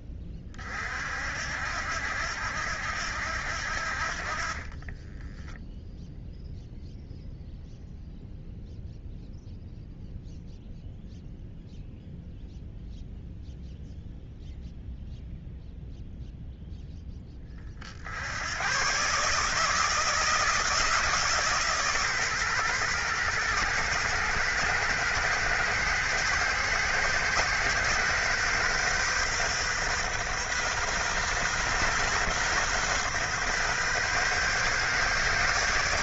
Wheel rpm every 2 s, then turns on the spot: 40, 80, 40, 0, 0, 0, 0, 0, 0, 100, 160, 130, 120, 120, 130, 130, 130, 130.
4-6